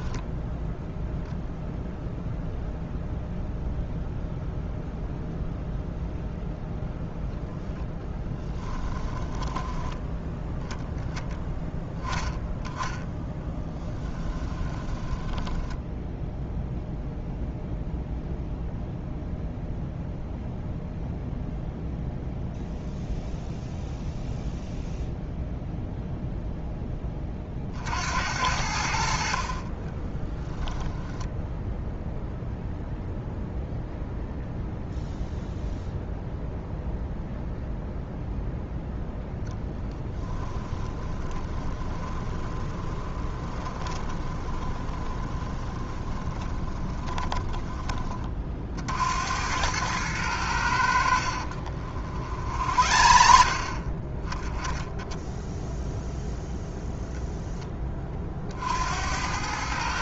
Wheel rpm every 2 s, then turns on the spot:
0, 0, 0, 10, 10, 10, 10, 10, 0, 0, 0, 0, 0, 20, 60, 10, 0, 0, 0, 0, 20, 20, 20, 20, 60, 70, 50, 10, 0, 70.
8-10 14-16 40-48 52-54